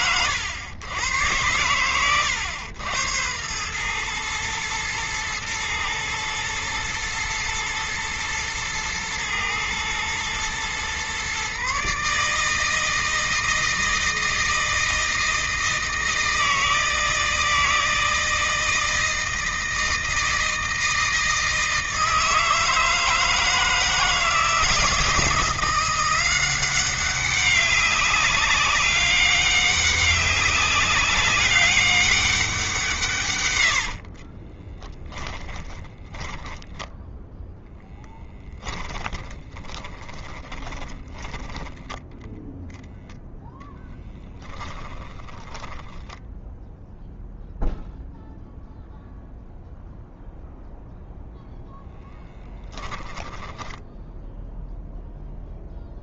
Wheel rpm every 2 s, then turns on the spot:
110, 90, 110, 110, 110, 120, 160, 160, 160, 160, 160, 160, 160, 190, 200, 200, 160, 20, 10, 10, 10, 0, 20, 0, 0, 0, 10, 0.
34-42 44-46 52-54